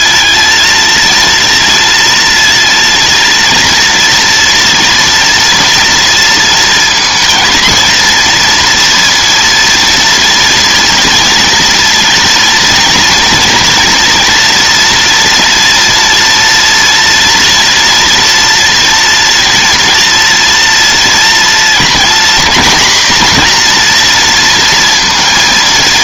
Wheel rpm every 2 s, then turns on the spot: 230, 230, 230, 230, 230, 230, 240, 230, 230, 230, 230, 240, 230.
none